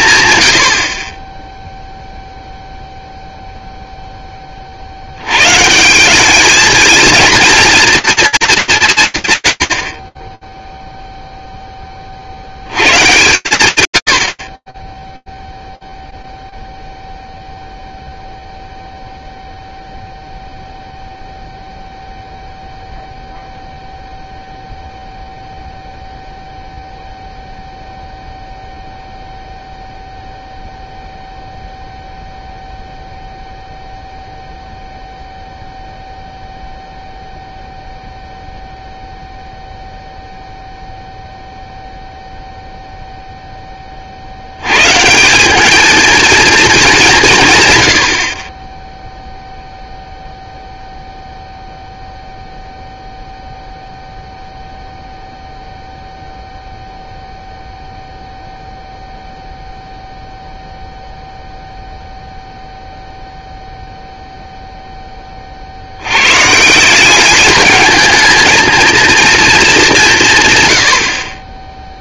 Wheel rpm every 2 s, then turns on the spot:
120, 0, 30, 220, 210, 0, 90, 50, 0, 0, 0, 0, 0, 0, 0, 0, 0, 0, 0, 0, 0, 0, 180, 150, 0, 0, 0, 0, 0, 0, 0, 0, 10, 190, 230, 70.
none